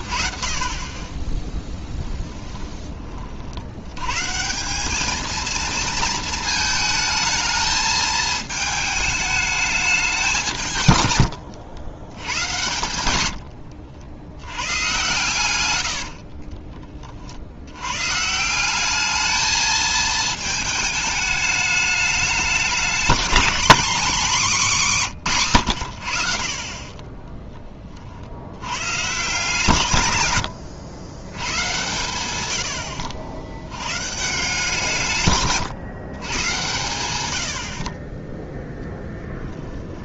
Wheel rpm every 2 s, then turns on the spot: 120, 20, 110, 230, 220, 200, 110, 100, 50, 170, 220, 210, 220, 40, 90, 100, 100, 150, 110, 10.
16-18